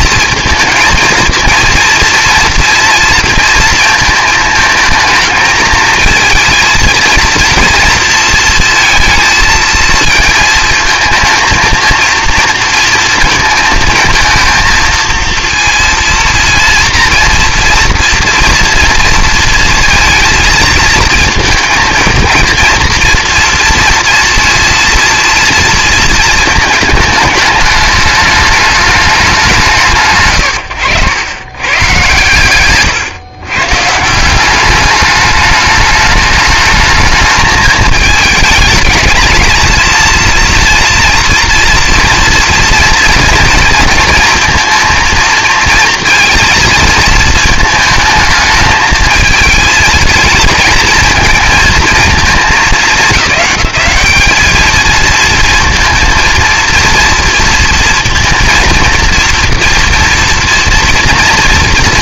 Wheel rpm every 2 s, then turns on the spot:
230, 230, 220, 230, 220, 220, 220, 230, 230, 230, 230, 230, 230, 220, 210, 100, 130, 200, 220, 210, 230, 230, 230, 230, 220, 220, 210, 220, 230, 230, 230.
none